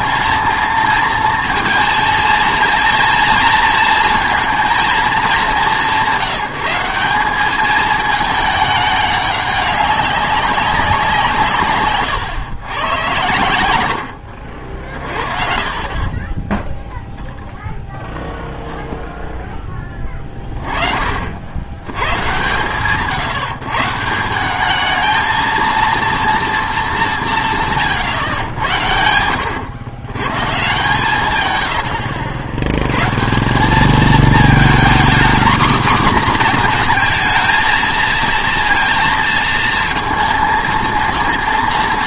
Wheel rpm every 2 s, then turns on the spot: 230, 230, 230, 180, 210, 190, 110, 50, 10, 10, 30, 140, 200, 220, 90, 150, 90, 230, 250, 230, 230.
none